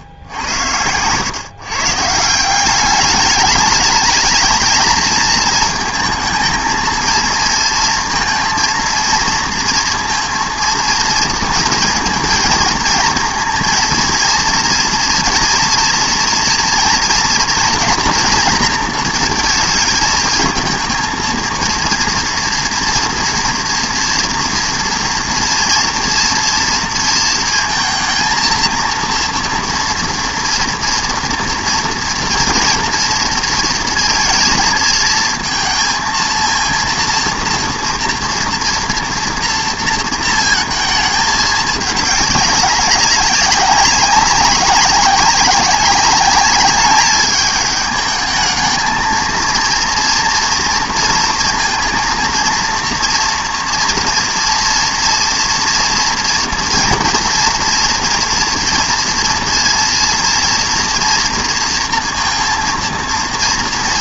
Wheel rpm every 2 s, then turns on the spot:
90, 180, 220, 220, 230, 230, 220, 230, 230, 230, 230, 230, 230, 230, 230, 230, 230, 220, 230, 230, 230, 200, 200, 200, 220, 230, 230, 230, 230, 240, 230, 230.
none